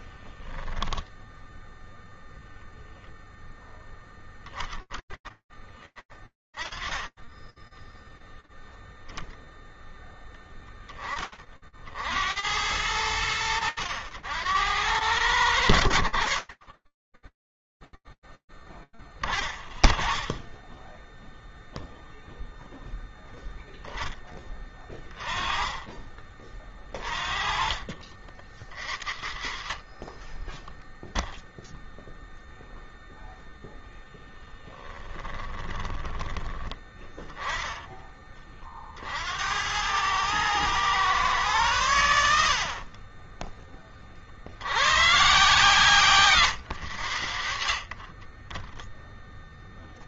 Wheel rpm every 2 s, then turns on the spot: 0, 0, 10, 20, 10, 0, 70, 90, 70, 0, 20, 0, 10, 30, 40, 10, 0, 10, 10, 50, 120, 30, 140, 80, 20.
34-36